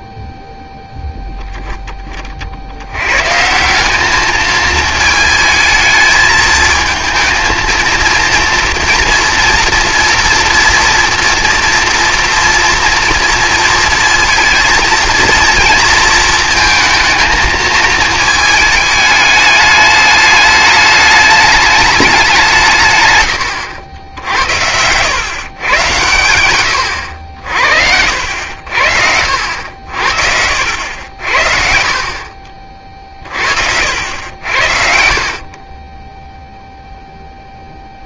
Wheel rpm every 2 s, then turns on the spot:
20, 20, 200, 220, 230, 230, 230, 230, 220, 220, 210, 200, 90, 110, 70, 70, 50, 80, 0.
28-30 32-34